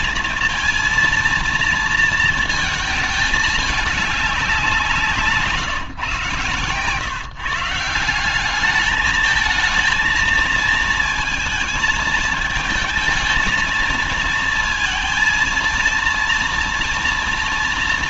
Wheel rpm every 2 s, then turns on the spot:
230, 220, 190, 130, 190, 230, 220, 230, 230.
none